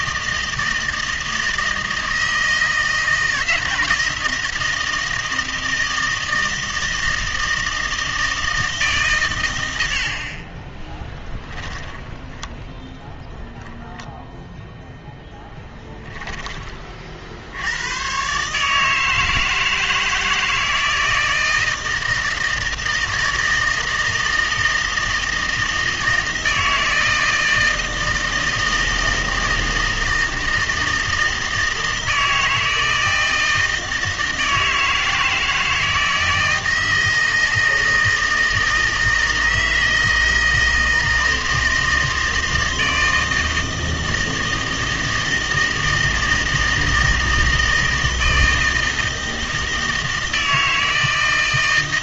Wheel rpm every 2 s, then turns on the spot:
160, 160, 160, 160, 160, 30, 10, 0, 30, 150, 160, 160, 160, 160, 160, 160, 160, 160, 160, 160, 160, 160, 160, 160, 160, 160.
10-12